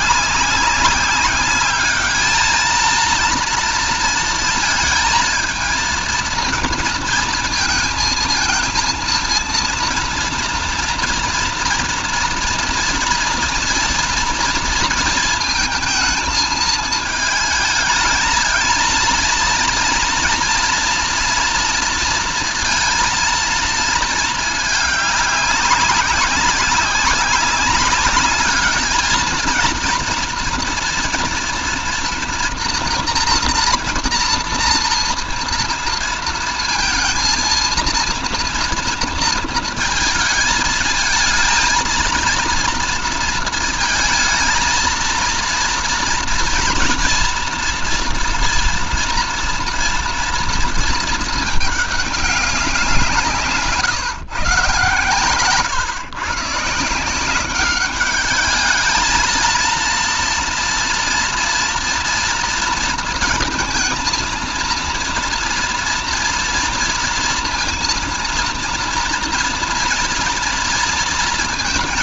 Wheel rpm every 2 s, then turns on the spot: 200, 220, 220, 230, 230, 230, 230, 230, 220, 230, 230, 230, 210, 190, 210, 230, 240, 230, 230, 230, 220, 230, 230, 230, 230, 230, 190, 130, 160, 220, 230, 230, 230, 230, 230, 230.
none